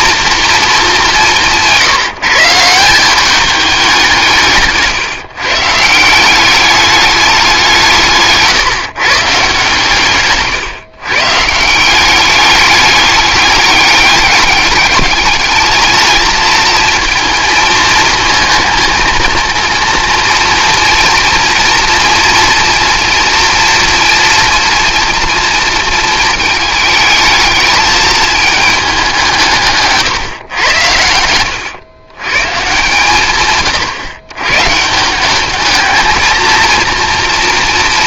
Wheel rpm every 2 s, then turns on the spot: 220, 160, 150, 200, 150, 130, 210, 210, 230, 230, 240, 230, 230, 220, 210, 110, 140, 140, 230.
none